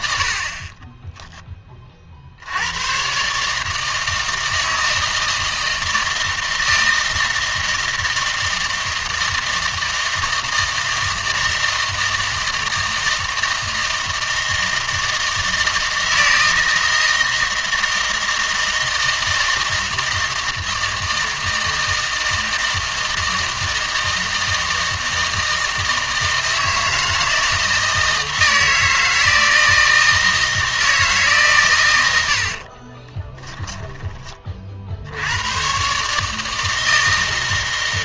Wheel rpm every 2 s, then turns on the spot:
30, 100, 160, 160, 160, 160, 160, 160, 160, 160, 160, 160, 160, 160, 160, 160, 40, 50, 160.
0-2 32-34